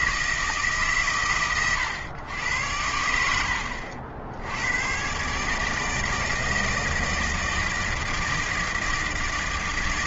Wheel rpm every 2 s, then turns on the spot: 150, 90, 90, 160, 160.
none